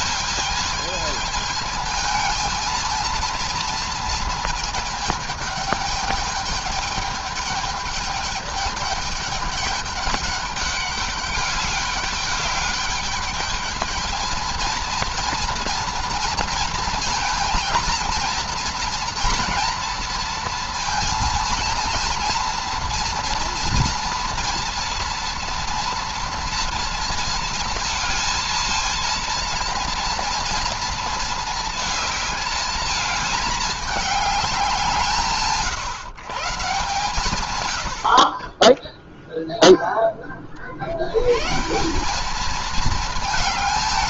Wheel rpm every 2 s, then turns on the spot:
220, 220, 220, 210, 210, 200, 200, 220, 230, 230, 230, 230, 230, 230, 230, 230, 220, 200, 140, 30, 40, 210.
none